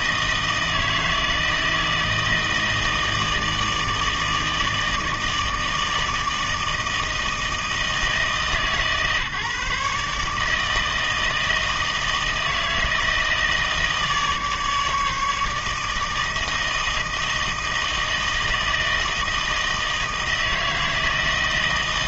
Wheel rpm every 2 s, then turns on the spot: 160, 160, 160, 160, 150, 160, 160, 150, 160, 160, 160.
none